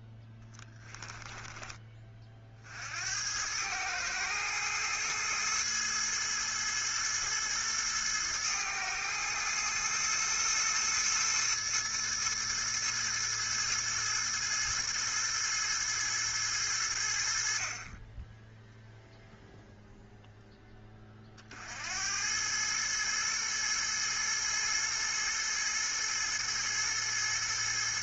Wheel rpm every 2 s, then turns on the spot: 10, 50, 110, 110, 110, 110, 110, 110, 110, 10, 0, 100, 110, 110.
0-2